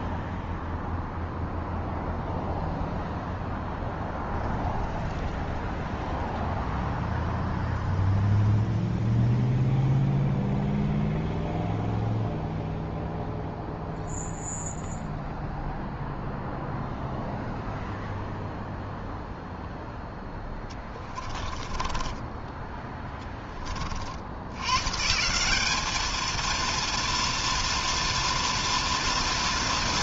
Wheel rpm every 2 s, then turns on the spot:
0, 0, 0, 0, 0, 0, 0, 0, 0, 0, 20, 10, 170, 230, 230.
20-22